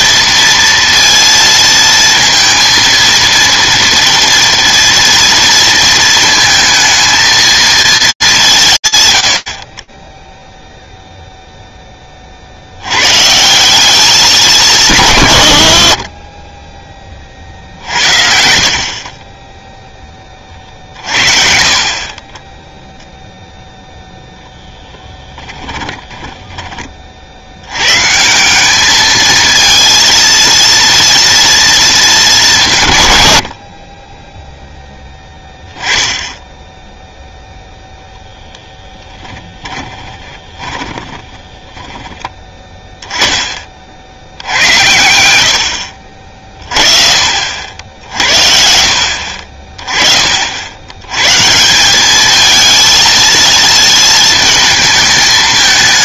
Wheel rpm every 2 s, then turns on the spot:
230, 230, 230, 220, 150, 0, 100, 180, 10, 60, 50, 0, 10, 40, 210, 230, 130, 10, 0, 10, 10, 10, 90, 50, 50, 110, 230, 220.
24-26 38-42